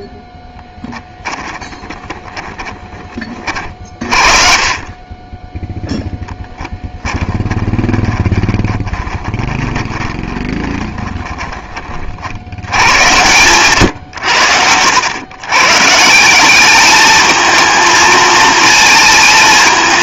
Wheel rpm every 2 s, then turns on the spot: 0, 10, 40, 10, 20, 20, 80, 90, 200, 220.
2-6 8-12